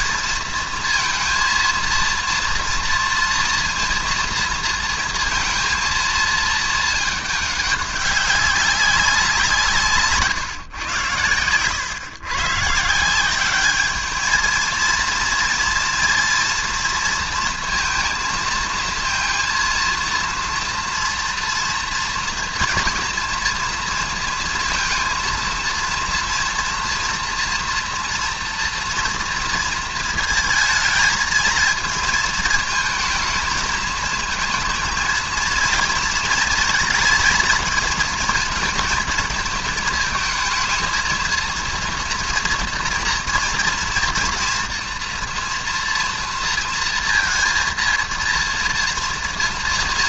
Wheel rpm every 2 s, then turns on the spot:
230, 230, 230, 220, 200, 140, 130, 220, 230, 230, 230, 230, 230, 230, 230, 220, 220, 220, 230, 220, 220, 230, 230, 230, 230.
none